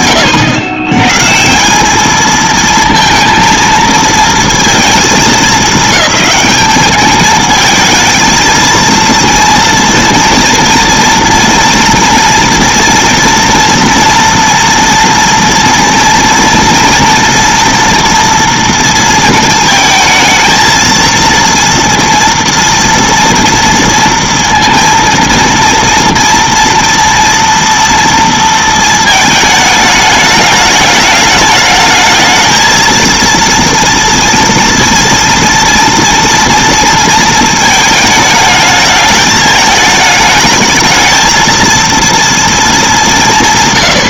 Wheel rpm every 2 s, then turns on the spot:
120, 230, 220, 210, 230, 230, 230, 230, 230, 230, 220, 230, 230, 230, 230, 210, 230, 230, 230, 210, 220, 210.
none